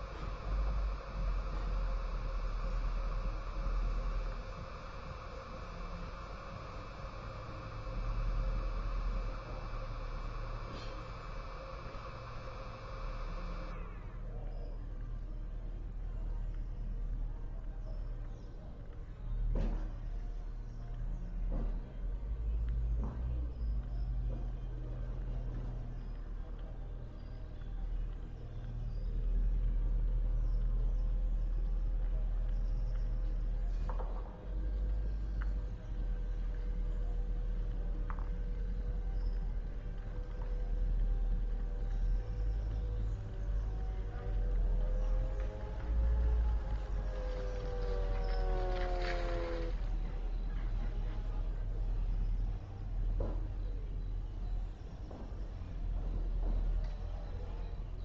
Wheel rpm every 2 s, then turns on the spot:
0, 0, 0, 0, 0, 0, 0, 0, 0, 0, 0, 0, 0, 0, 0, 0, 0, 0, 0, 0, 0, 0, 0, 0, 0, 0, 0, 0, 0.
none